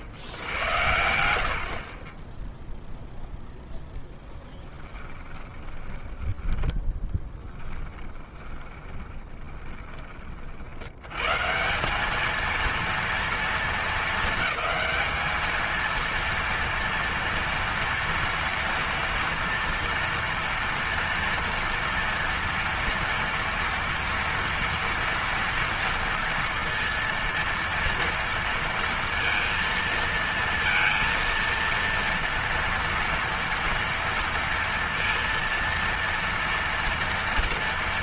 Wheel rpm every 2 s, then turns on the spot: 90, 20, 0, 10, 20, 100, 230, 220, 230, 230, 230, 230, 230, 230, 230, 230, 230, 230, 230.
6-10